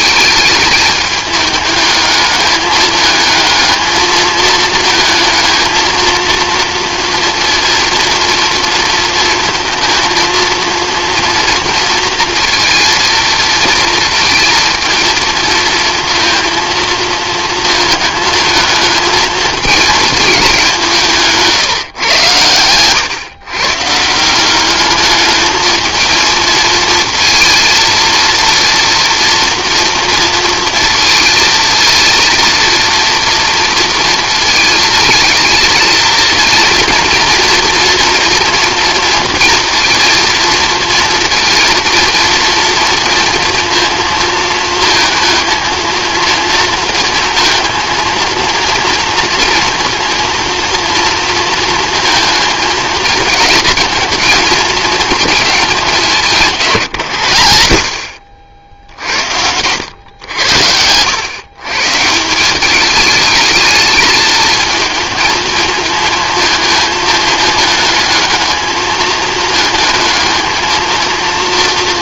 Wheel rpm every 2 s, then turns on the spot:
210, 210, 220, 230, 230, 230, 230, 230, 230, 220, 210, 120, 170, 220, 230, 230, 230, 230, 230, 230, 230, 230, 220, 230, 230, 230, 220, 220, 200, 60, 100, 160, 220, 220, 210, 220.
none